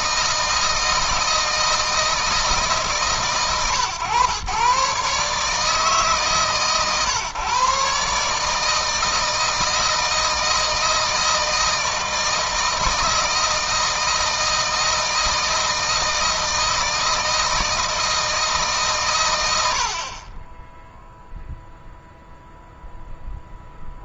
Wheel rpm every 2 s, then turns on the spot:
160, 150, 130, 130, 160, 160, 160, 160, 160, 150, 20, 0.
none